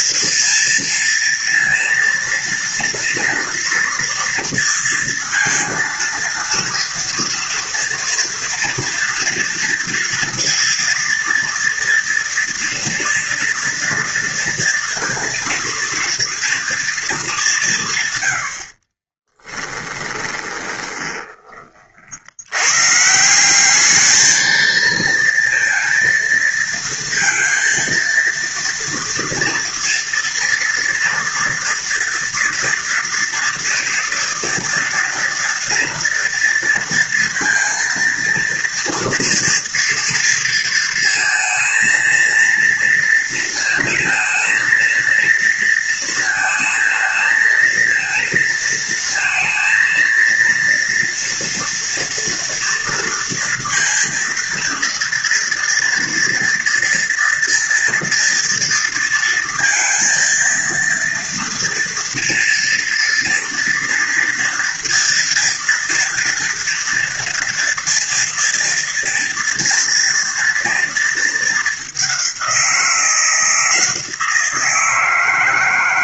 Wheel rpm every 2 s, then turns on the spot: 230, 230, 230, 230, 230, 230, 230, 230, 200, 30, 10, 150, 230, 230, 230, 230, 230, 230, 230, 240, 230, 230, 230, 220, 230, 230, 230, 230, 230, 230, 230, 230, 230, 230, 240, 230, 170, 170.
18-22